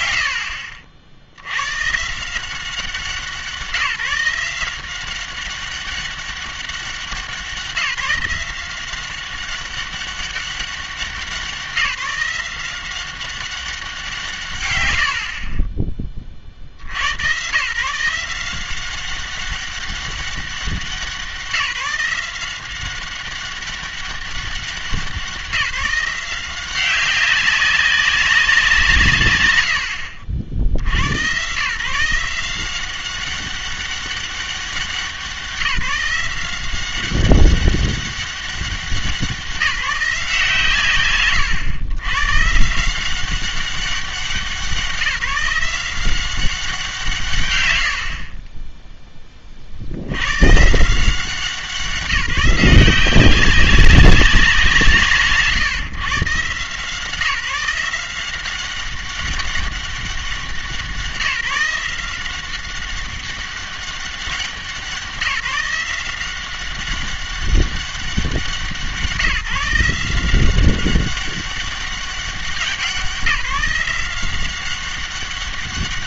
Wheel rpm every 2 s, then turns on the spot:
90, 180, 180, 190, 180, 190, 180, 110, 70, 180, 190, 190, 190, 190, 180, 70, 180, 190, 180, 190, 150, 160, 190, 180, 20, 150, 180, 170, 160, 190, 180, 190, 190, 190, 180, 190, 190, 190.
none